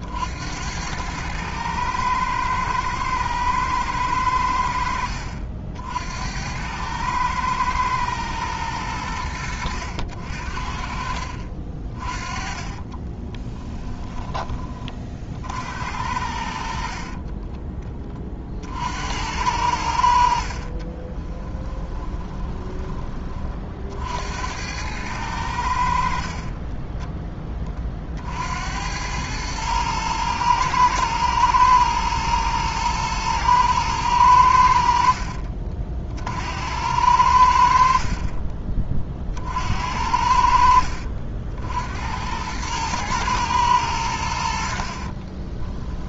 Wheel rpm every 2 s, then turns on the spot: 90, 110, 80, 100, 110, 60, 40, 20, 60, 50, 50, 20, 90, 30, 70, 110, 110, 90, 80, 30, 60, 110, 60.
12-14 20-22 38-40 44-46